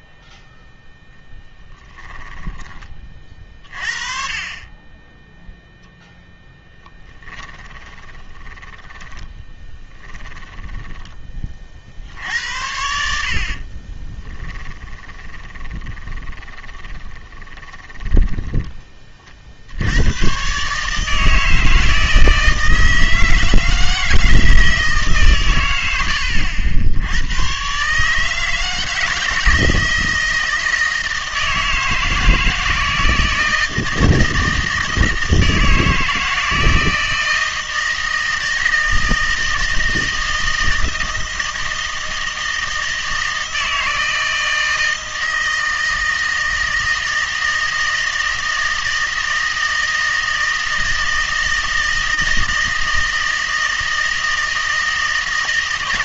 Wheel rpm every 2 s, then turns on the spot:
10, 20, 30, 10, 20, 20, 70, 10, 20, 10, 140, 160, 160, 90, 160, 160, 160, 160, 160, 160, 160, 160, 160, 160, 160, 160, 160, 160.
8-12 14-18